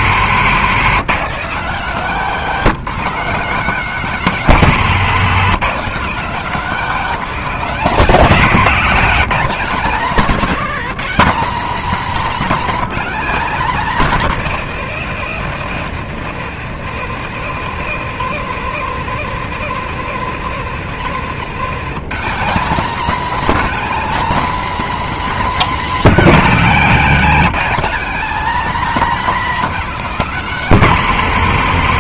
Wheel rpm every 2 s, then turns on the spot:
210, 230, 220, 230, 210, 230, 230, 200, 170, 210, 200, 230, 250, 220, 230, 220.
8-10